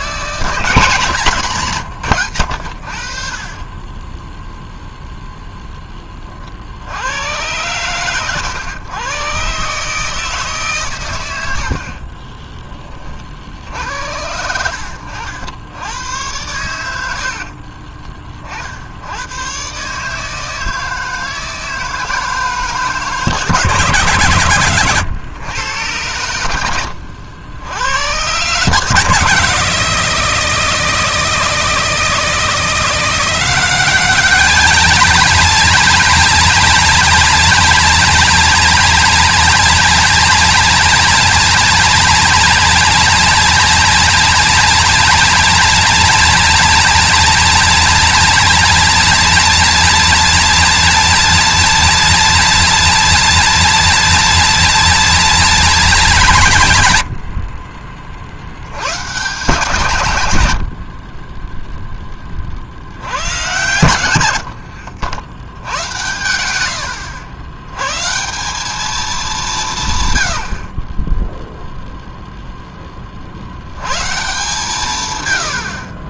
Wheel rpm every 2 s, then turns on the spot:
160, 60, 0, 70, 110, 130, 20, 80, 90, 70, 160, 160, 120, 80, 140, 160, 170, 220, 230, 230, 230, 230, 230, 230, 230, 230, 230, 230, 140, 110, 70, 70, 70, 90, 190, 30, 20, 140.
64-66